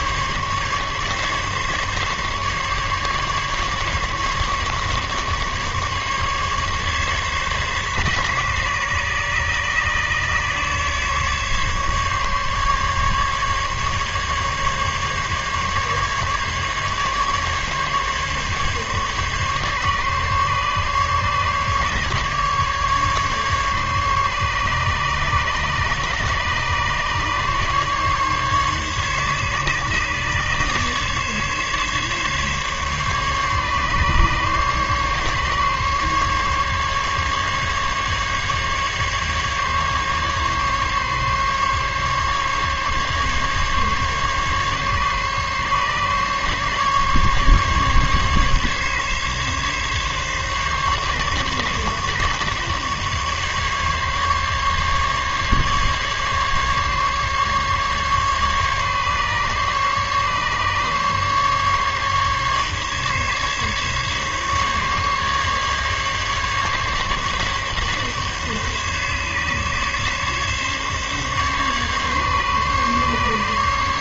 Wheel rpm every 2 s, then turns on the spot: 140, 140, 140, 140, 140, 140, 140, 140, 140, 140, 140, 150, 140, 140, 140, 140, 140, 140, 140, 140, 140, 140, 140, 140, 140, 140, 140, 140, 140, 140, 140, 140, 140, 140, 140, 140, 140.
none